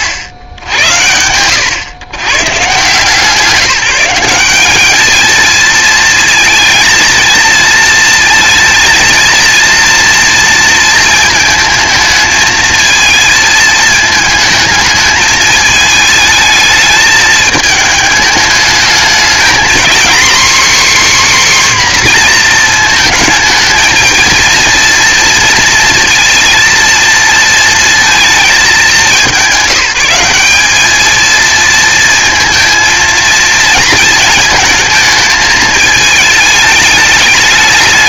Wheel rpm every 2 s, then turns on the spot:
90, 130, 200, 230, 230, 230, 220, 220, 210, 210, 280, 230, 230, 230, 210, 210, 220, 220, 210.
none